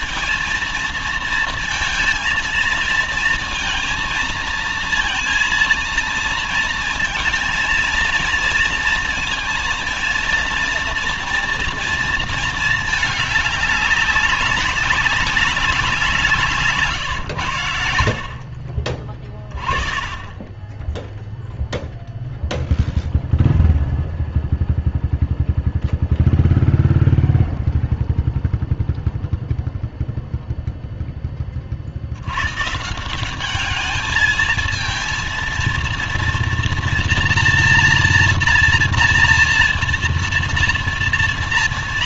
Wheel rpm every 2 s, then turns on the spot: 230, 230, 230, 230, 230, 230, 220, 190, 170, 50, 20, 0, 0, 0, 0, 0, 120, 220, 230, 230, 230.
16-18